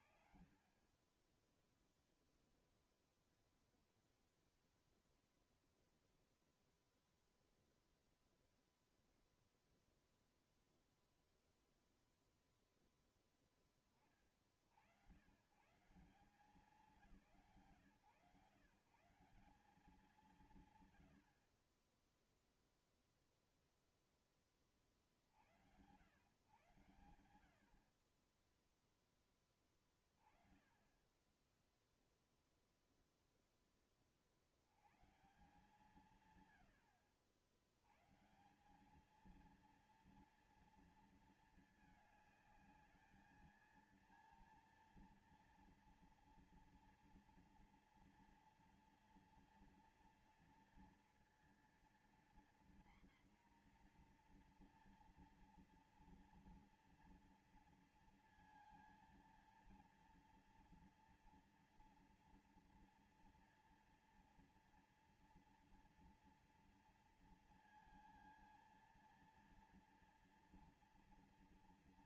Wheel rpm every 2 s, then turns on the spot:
50, 0, 0, 0, 0, 0, 60, 190, 140, 160, 0, 0, 90, 50, 10, 10, 10, 140, 80, 220, 220, 220, 230, 230, 230, 230, 240, 230, 230, 230, 230, 230, 230, 230, 230, 240.
none